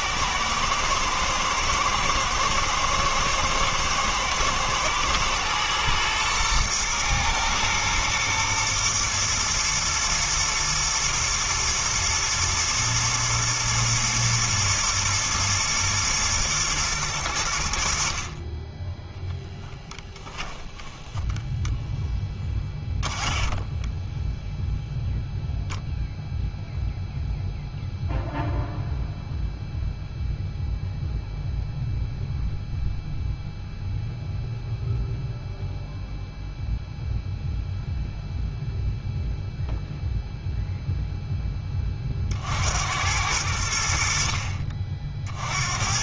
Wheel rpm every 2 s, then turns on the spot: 110, 120, 110, 120, 120, 110, 120, 120, 110, 10, 20, 20, 0, 0, 0, 0, 0, 0, 0, 0, 0, 90, 40.
20-24